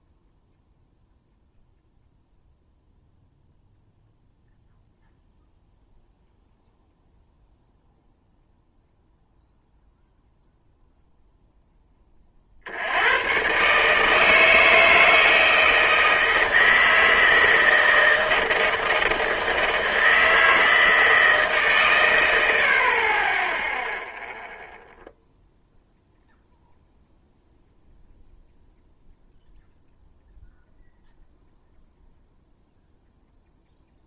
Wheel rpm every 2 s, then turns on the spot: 0, 0, 0, 0, 0, 0, 70, 160, 160, 170, 160, 50, 0, 0, 0, 0, 0.
none